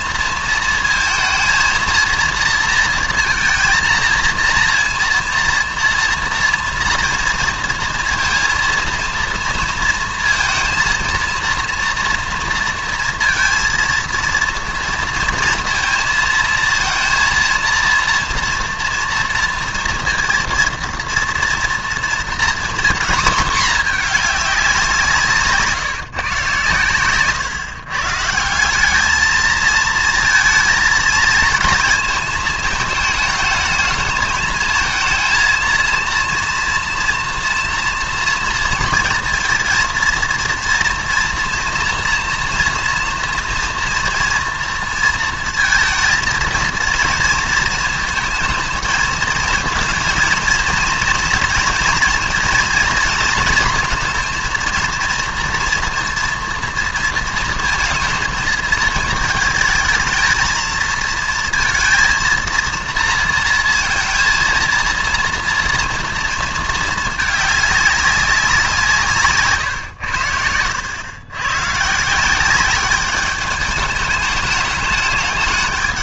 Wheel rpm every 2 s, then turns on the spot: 230, 230, 230, 230, 230, 230, 230, 230, 230, 230, 230, 240, 190, 130, 180, 230, 220, 220, 230, 230, 230, 240, 240, 230, 220, 230, 230, 230, 230, 220, 230, 230, 230, 220, 170, 90, 190, 210.
70-72